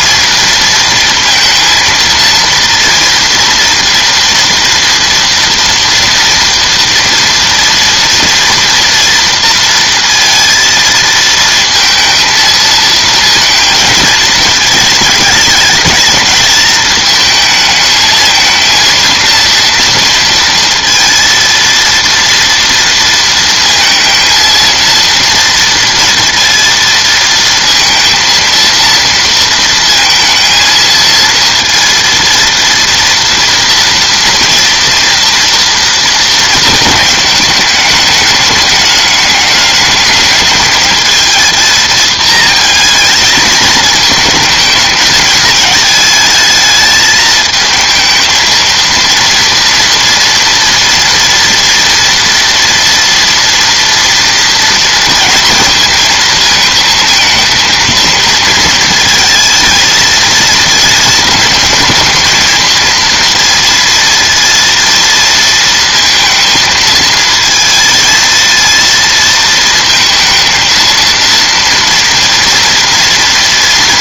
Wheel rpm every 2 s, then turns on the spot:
220, 230, 230, 230, 230, 230, 230, 220, 220, 230, 230, 230, 230, 230, 230, 230, 230, 230, 220, 210, 220, 220, 220, 220, 220, 230, 230, 230, 220, 220, 220, 230, 230, 230, 230, 230, 230.
none